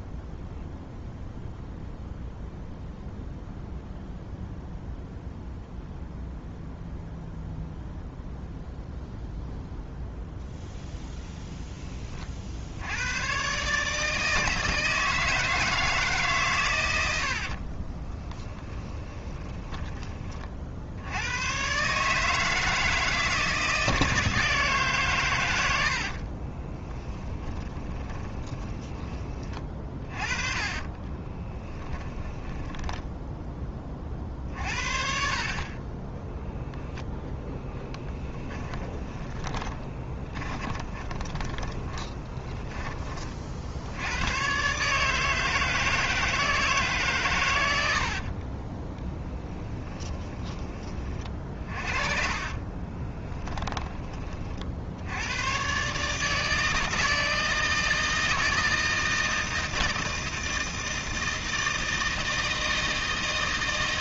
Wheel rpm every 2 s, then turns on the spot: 0, 0, 0, 0, 0, 0, 90, 160, 100, 20, 70, 160, 140, 20, 20, 20, 10, 50, 0, 10, 30, 30, 140, 150, 20, 30, 20, 70, 160, 160, 160, 150.
18-20 26-28 30-34 38-42 48-50 52-54